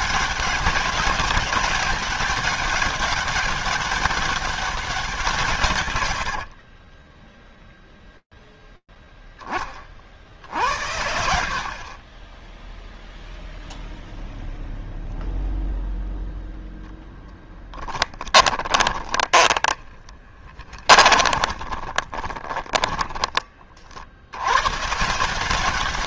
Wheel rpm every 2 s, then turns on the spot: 190, 200, 200, 60, 0, 70, 0, 0, 0, 10, 20, 20, 130.
6-8 18-24